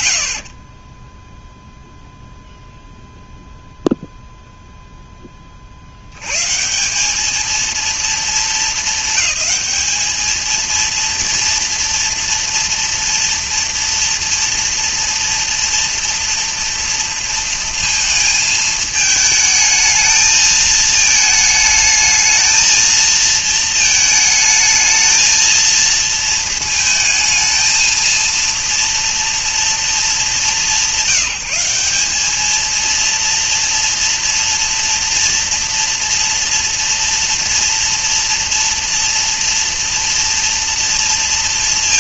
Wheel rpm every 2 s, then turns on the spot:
40, 0, 0, 160, 220, 230, 230, 230, 230, 220, 220, 230, 220, 220, 230, 170, 230, 240, 230, 230, 230.
none